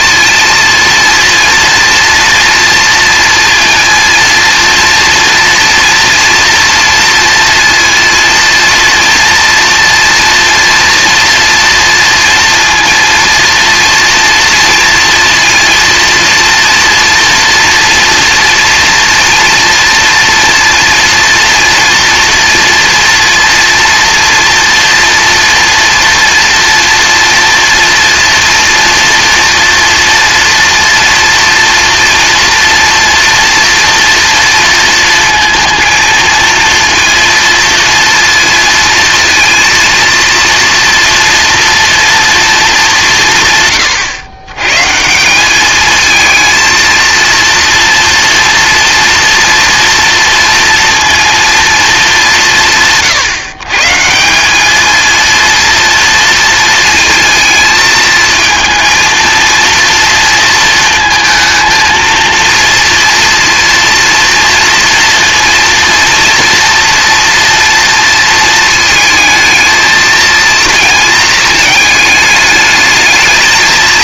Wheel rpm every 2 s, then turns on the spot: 230, 230, 230, 230, 230, 230, 230, 230, 230, 230, 240, 230, 230, 230, 230, 230, 230, 230, 230, 230, 230, 200, 130, 230, 230, 230, 150, 200, 230, 230, 230, 230, 230, 230, 220, 230, 210.
none